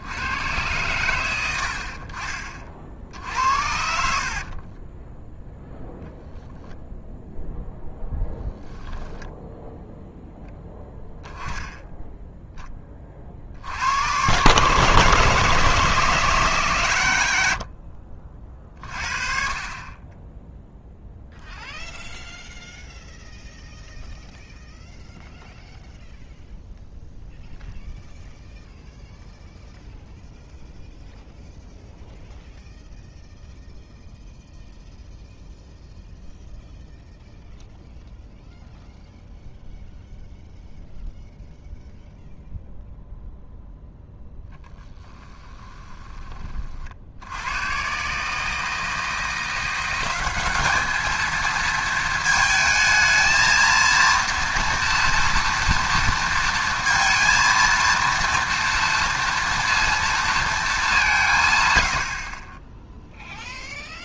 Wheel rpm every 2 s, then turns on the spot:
110, 60, 30, 10, 10, 10, 10, 140, 140, 40, 0, 0, 0, 0, 0, 0, 0, 0, 0, 0, 0, 0, 10, 40, 160, 210, 220, 230, 230, 230, 200, 10.
4-6 8-10 44-46